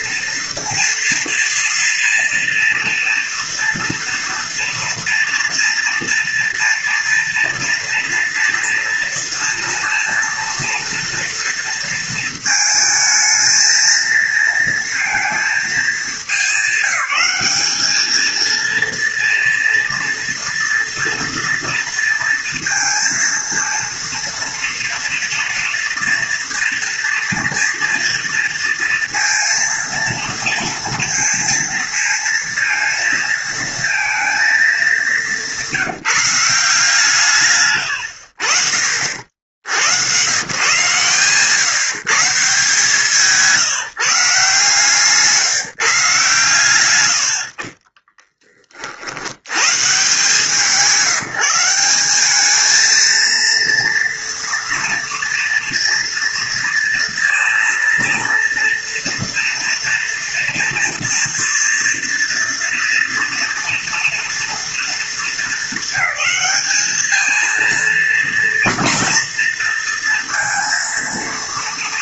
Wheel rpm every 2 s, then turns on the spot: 230, 230, 230, 230, 230, 230, 220, 230, 200, 230, 230, 230, 230, 230, 230, 230, 230, 210, 160, 60, 120, 150, 150, 130, 40, 170, 210, 240, 230, 230, 230, 230, 230, 210, 230, 230.
none